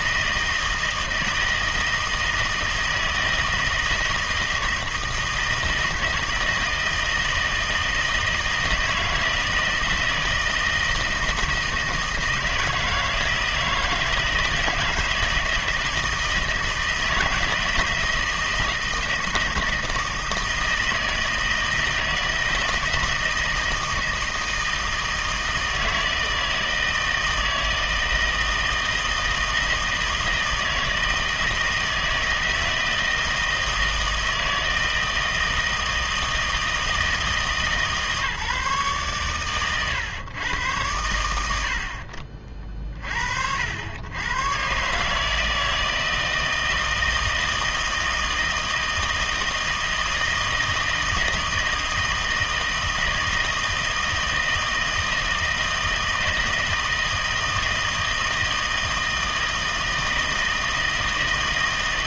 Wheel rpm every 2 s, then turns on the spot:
160, 160, 160, 160, 160, 160, 160, 160, 160, 160, 160, 160, 160, 160, 160, 160, 160, 160, 160, 140, 100, 40, 120, 160, 160, 160, 160, 160, 160, 160, 160.
none